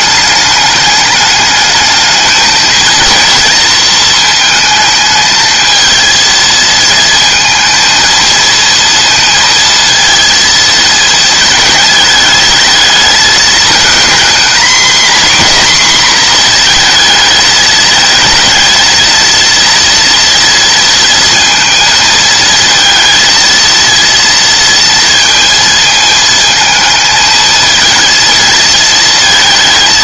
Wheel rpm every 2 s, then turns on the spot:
210, 230, 220, 220, 230, 230, 220, 240, 230, 220, 230, 230, 230, 220, 230.
none